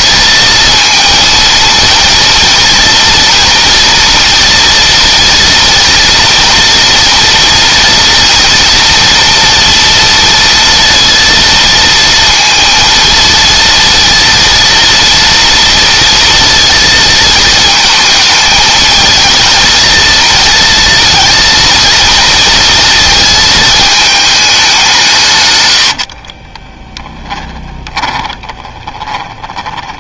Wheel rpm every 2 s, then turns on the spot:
230, 230, 230, 240, 230, 230, 230, 230, 230, 220, 230, 220, 180, 20, 20.
26-30